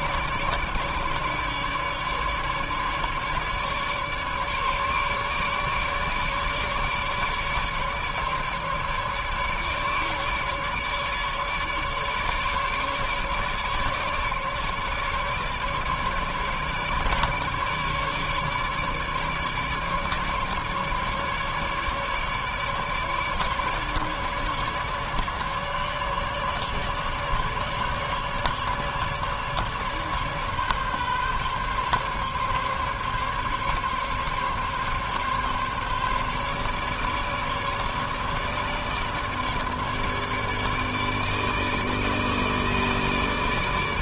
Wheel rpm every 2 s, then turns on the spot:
150, 150, 150, 150, 150, 150, 150, 150, 150, 150, 150, 150, 150, 150, 150, 140, 140, 140, 140, 150, 150, 160.
none